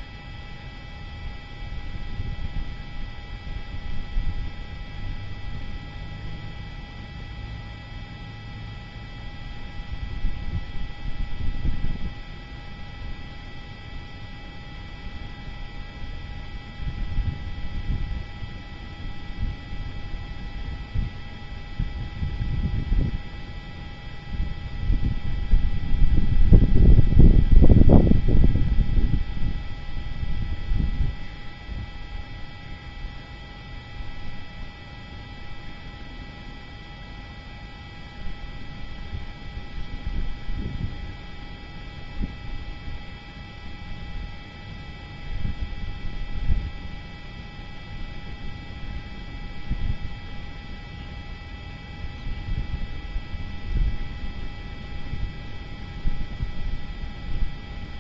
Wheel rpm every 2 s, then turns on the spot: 0, 0, 0, 0, 0, 0, 0, 0, 0, 0, 0, 0, 0, 0, 0, 0, 0, 0, 0, 0, 0, 0, 0, 0, 0, 0, 0, 0, 0.
none